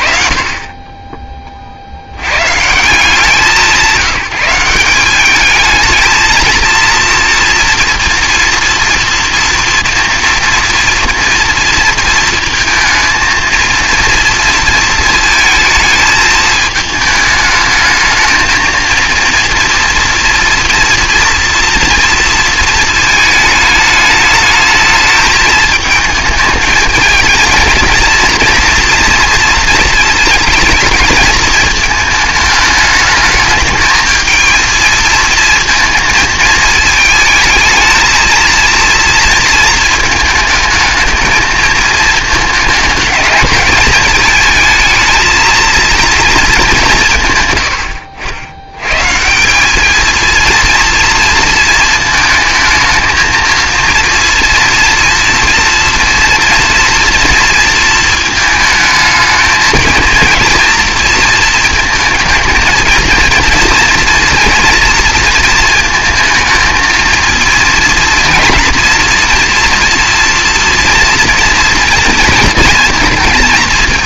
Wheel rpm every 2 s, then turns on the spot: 40, 140, 180, 230, 230, 230, 230, 230, 220, 220, 230, 230, 220, 220, 230, 220, 220, 230, 220, 230, 220, 220, 220, 230, 100, 230, 220, 230, 230, 220, 230, 220, 230, 220, 230, 240, 230.
none